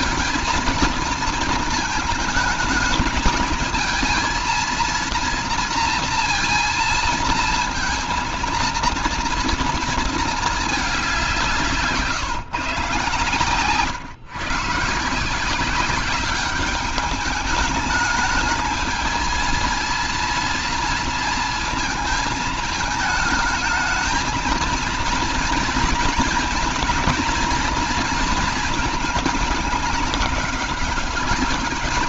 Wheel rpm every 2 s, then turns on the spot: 230, 220, 230, 230, 230, 190, 130, 160, 210, 220, 230, 220, 230, 230, 220, 200.
none